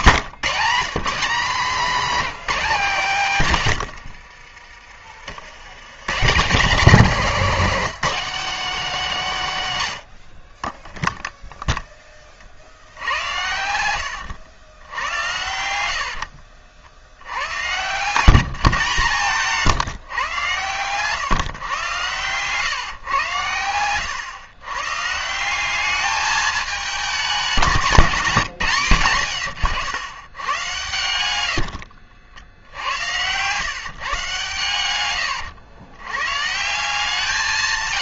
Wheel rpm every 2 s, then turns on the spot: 170, 210, 50, 170, 230, 30, 50, 100, 60, 160, 130, 120, 130, 210, 160, 110, 80, 130, 140.
4-6 18-20